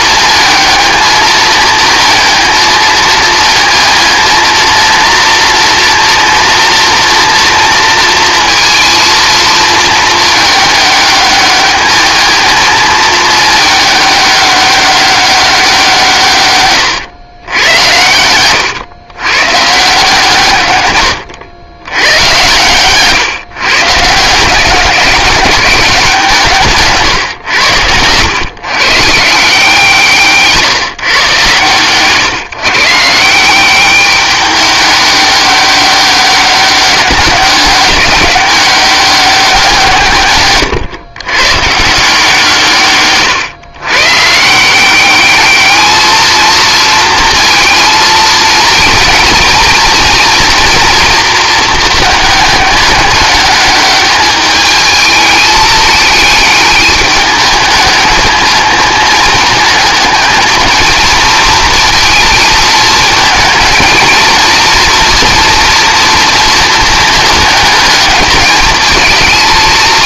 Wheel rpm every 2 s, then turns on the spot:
220, 230, 230, 240, 230, 210, 220, 200, 130, 110, 120, 120, 190, 150, 130, 160, 150, 200, 200, 190, 120, 140, 180, 230, 230, 230, 210, 210, 210, 220, 230, 220, 230, 220, 220.
16-18 26-28